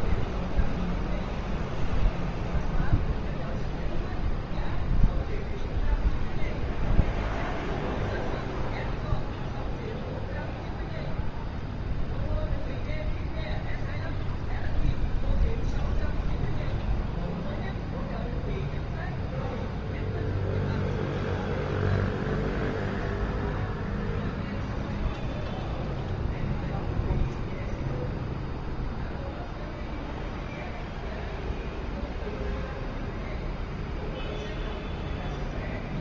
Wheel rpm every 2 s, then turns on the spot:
0, 0, 0, 0, 0, 0, 0, 0, 0, 0, 0, 0, 0, 0, 0, 0, 0, 0.
none